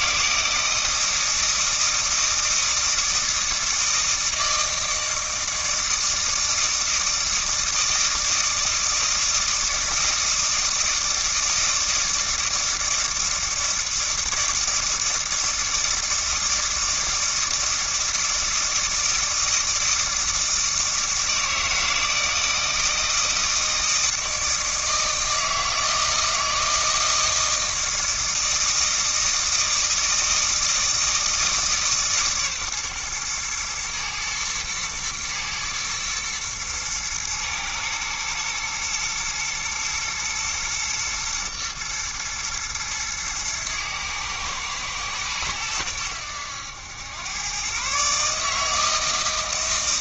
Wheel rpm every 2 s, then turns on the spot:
160, 160, 160, 160, 160, 160, 160, 160, 160, 160, 160, 160, 160, 160, 160, 160, 130, 110, 110, 110, 120, 120, 110, 100, 160.
none